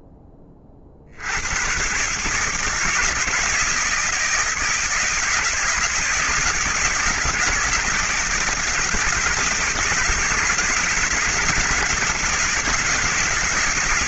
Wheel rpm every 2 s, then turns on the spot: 20, 150, 160, 160, 160, 160, 160.
none